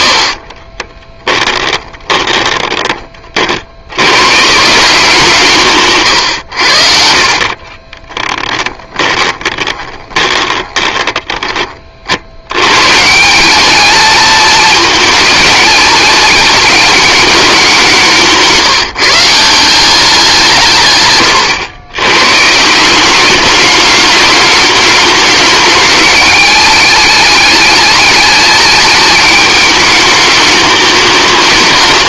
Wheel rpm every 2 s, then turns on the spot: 20, 30, 170, 70, 20, 20, 130, 220, 220, 160, 130, 170, 210, 210, 210, 210.
0-2 6-12